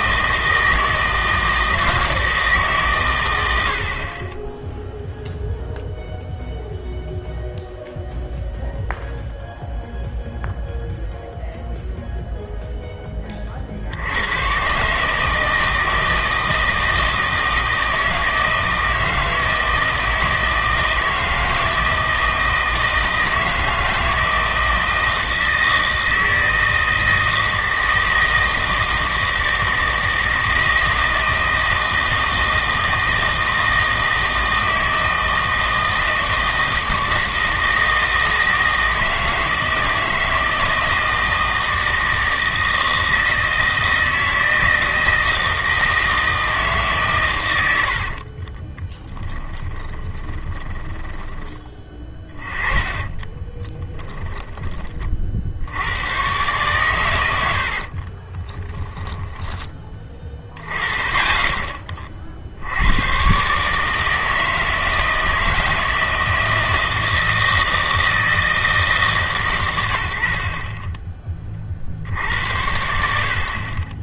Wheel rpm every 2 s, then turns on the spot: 160, 140, 10, 0, 0, 0, 0, 140, 160, 160, 160, 160, 160, 160, 160, 160, 160, 160, 160, 160, 160, 160, 160, 150, 40, 10, 20, 20, 120, 10, 20, 80, 160, 160, 160, 30, 80.
48-54 58-60